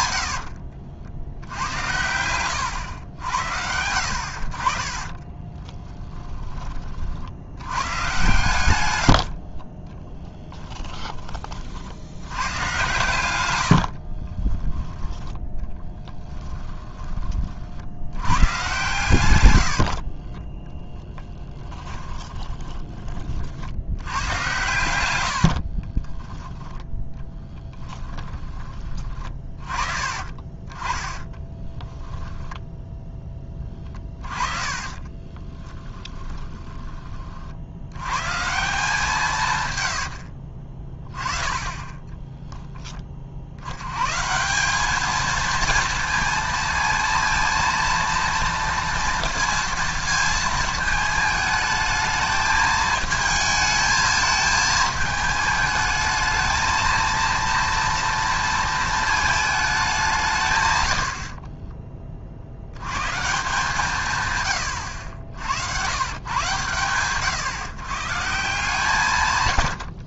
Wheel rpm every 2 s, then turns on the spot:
70, 100, 40, 20, 110, 10, 110, 20, 10, 120, 10, 20, 110, 10, 20, 30, 0, 30, 20, 160, 40, 10, 190, 230, 230, 220, 220, 220, 220, 230, 120, 80, 100, 120, 160.
0-2 14-16 28-30 34-38 40-42